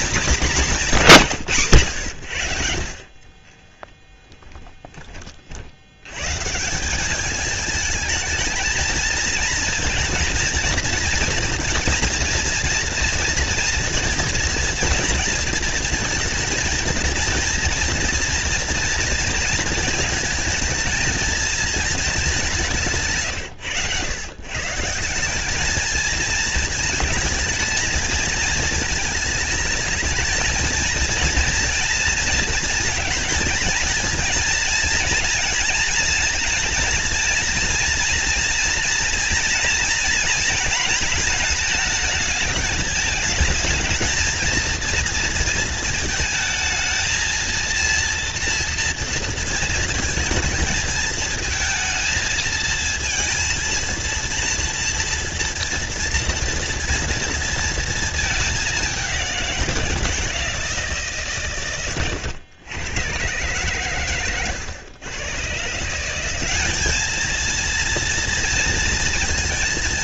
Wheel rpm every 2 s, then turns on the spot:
220, 70, 20, 150, 220, 230, 240, 230, 230, 230, 220, 180, 130, 230, 220, 220, 230, 230, 230, 230, 230, 220, 230, 220, 230, 220, 230, 230, 240, 210, 170, 110, 110, 190, 230.
4-6